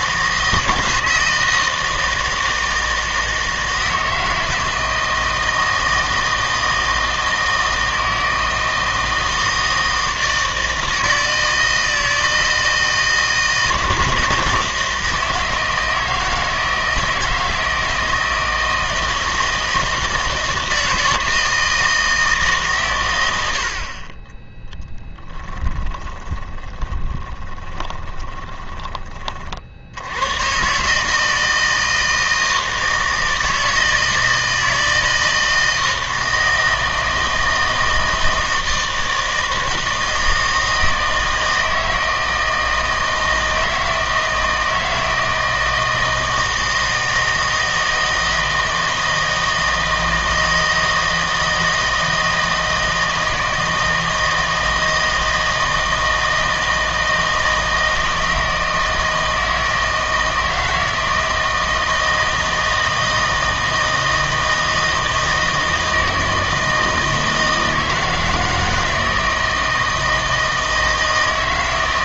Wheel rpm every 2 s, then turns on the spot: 160, 160, 160, 160, 160, 160, 160, 160, 160, 160, 160, 130, 10, 20, 20, 140, 160, 160, 160, 160, 160, 160, 160, 160, 160, 160, 160, 160, 160, 160, 160, 160, 160, 160, 160, 160.
26-28